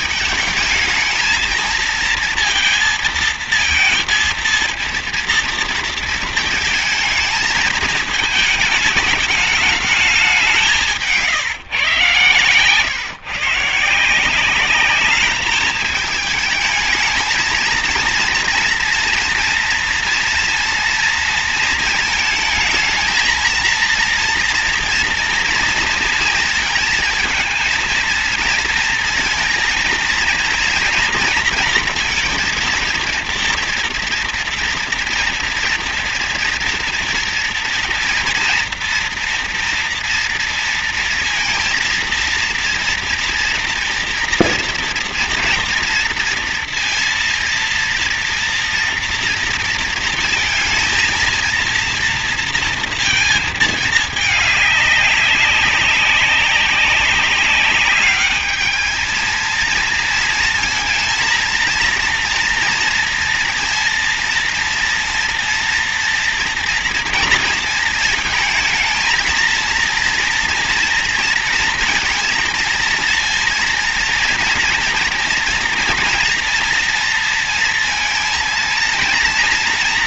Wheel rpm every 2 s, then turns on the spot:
220, 220, 230, 230, 220, 170, 140, 200, 210, 230, 230, 230, 230, 220, 230, 230, 230, 230, 230, 230, 230, 230, 230, 230, 230, 220, 230, 200, 190, 220, 230, 230, 230, 240, 220, 230, 230, 230, 230, 230.
10-12